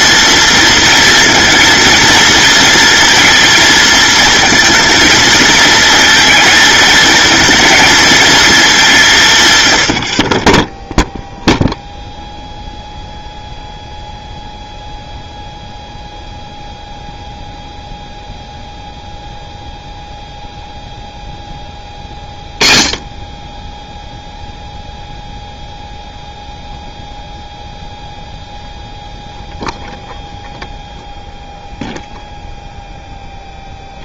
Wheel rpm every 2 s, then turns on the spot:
230, 230, 220, 220, 190, 0, 0, 0, 0, 0, 0, 20, 0, 0, 0, 0, 0.
none